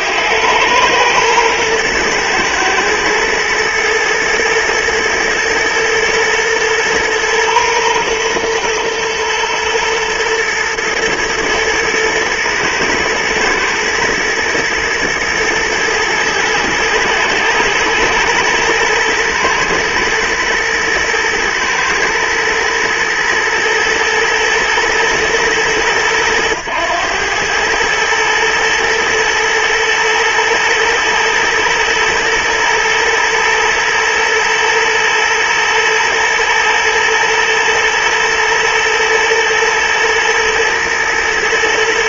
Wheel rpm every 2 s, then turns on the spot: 110, 110, 110, 110, 120, 120, 110, 110, 110, 110, 110, 110, 110, 100, 110, 110, 120, 110, 110, 120, 110.
none